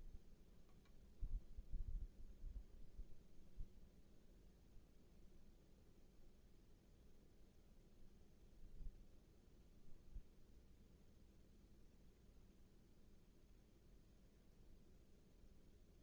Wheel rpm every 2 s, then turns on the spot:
0, 0, 0, 0, 0, 0, 0, 0.
none